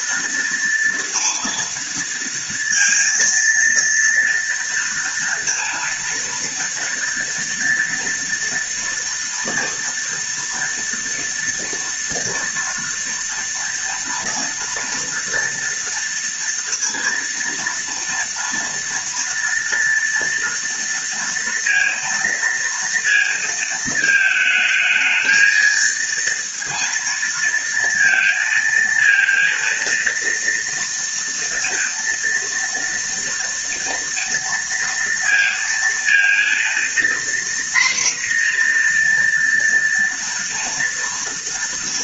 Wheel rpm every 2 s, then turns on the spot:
230, 230, 230, 230, 230, 230, 230, 230, 230, 230, 230, 230, 220, 230, 230, 230, 230, 230, 240, 240, 230.
none